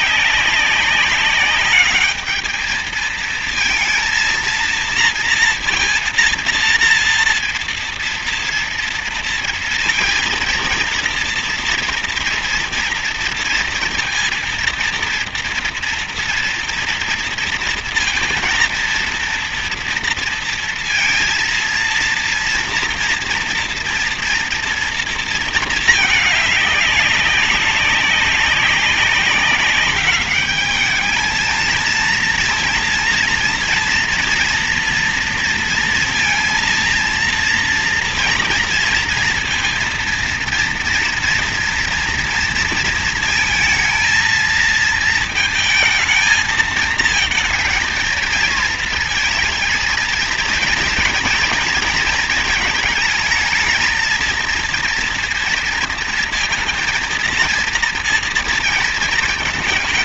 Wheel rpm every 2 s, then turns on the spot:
200, 220, 230, 230, 230, 230, 230, 230, 230, 230, 230, 230, 230, 200, 200, 220, 230, 240, 230, 230, 230, 220, 230, 220, 220, 230, 220, 230, 230, 220.
none